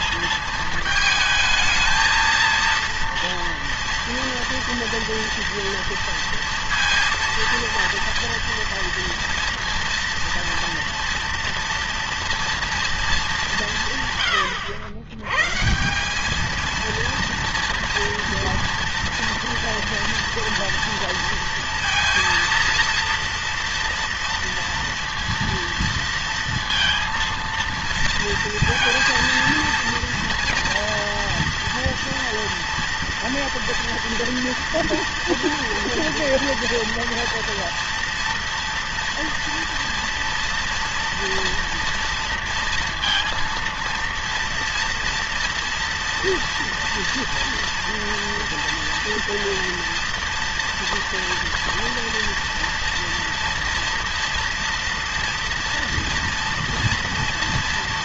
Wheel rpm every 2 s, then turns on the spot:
220, 230, 230, 230, 230, 230, 230, 110, 230, 230, 230, 230, 230, 230, 230, 230, 230, 230, 230, 230, 230, 230, 230, 230, 230, 230, 230, 230, 230.
none